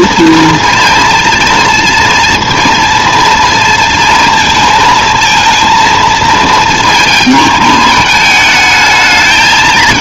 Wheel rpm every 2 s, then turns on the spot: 230, 230, 230, 220, 220.
none